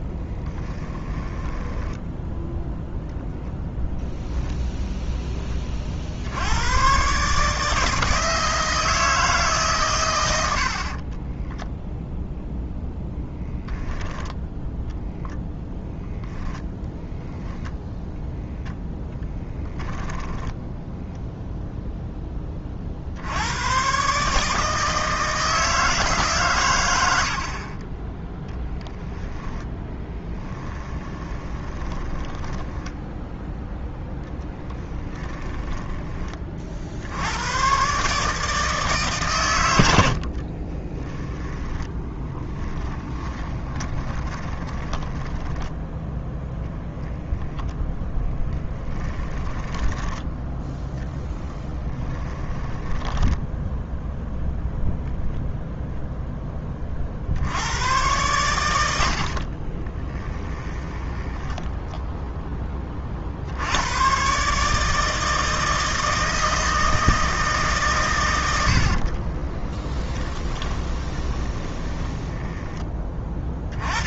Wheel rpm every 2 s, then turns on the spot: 10, 10, 0, 90, 160, 70, 0, 0, 0, 0, 10, 30, 150, 130, 10, 10, 10, 10, 40, 150, 40, 10, 20, 0, 20, 0, 10, 0, 10, 100, 20, 30, 160, 160, 50, 10, 10.
0-2 10-12 20-22 30-36 40-46 48-50 52-54 60-62 68-72